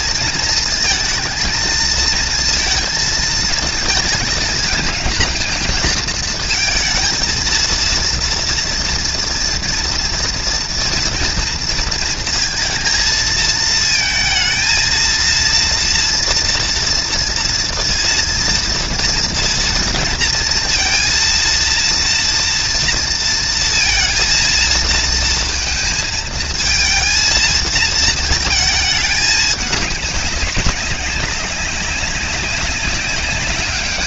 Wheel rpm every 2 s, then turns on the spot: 230, 220, 220, 220, 230, 230, 220, 230, 230, 230, 230, 230, 230, 220, 220, 200, 200.
none